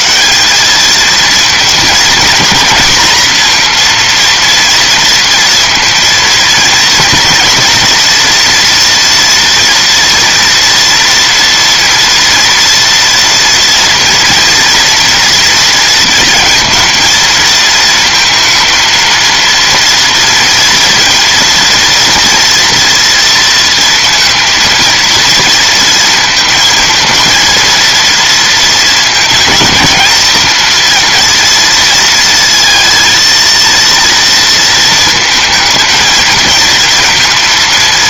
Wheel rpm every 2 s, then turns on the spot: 110, 220, 230, 230, 230, 230, 230, 230, 230, 230, 230, 230, 230, 230, 230, 230, 230, 230, 230.
none